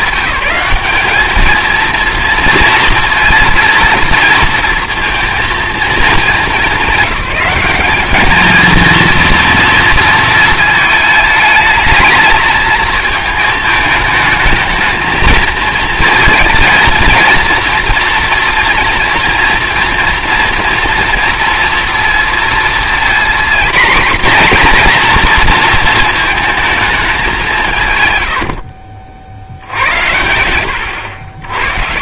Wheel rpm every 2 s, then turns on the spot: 200, 230, 230, 210, 230, 230, 220, 220, 230, 240, 230, 230, 240, 220, 60, 80.
none